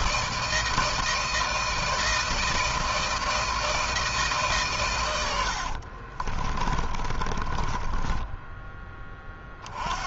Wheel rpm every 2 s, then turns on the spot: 160, 160, 130, 30, 10.
6-8